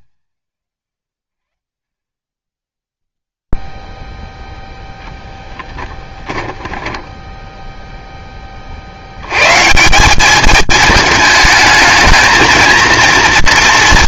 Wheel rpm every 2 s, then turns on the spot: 120, 10, 0, 10, 40, 210, 230.
none